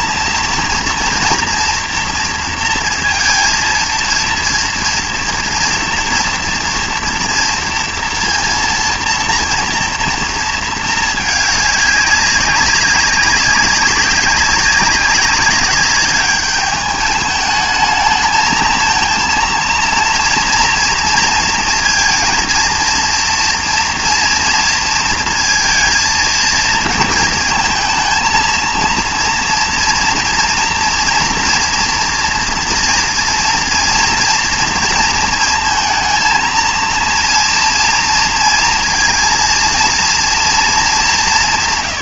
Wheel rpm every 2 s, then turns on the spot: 230, 230, 230, 230, 230, 220, 190, 200, 210, 220, 230, 230, 230, 220, 230, 230, 230, 230, 230, 230, 220.
none